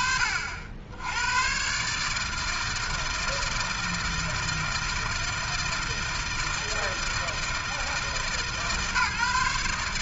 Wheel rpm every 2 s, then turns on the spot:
70, 160, 160, 160, 150.
none